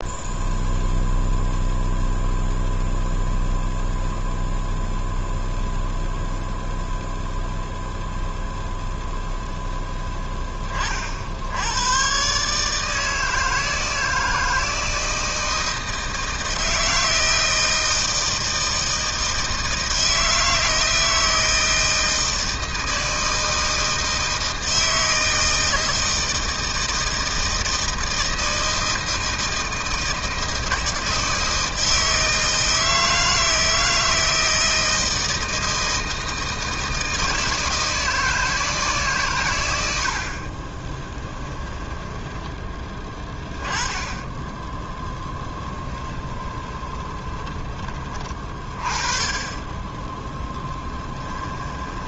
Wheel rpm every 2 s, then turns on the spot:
0, 0, 0, 0, 0, 50, 160, 160, 160, 160, 160, 160, 160, 160, 160, 160, 160, 160, 160, 140, 20, 10, 10, 20, 30, 20.
40-42 44-48 50-52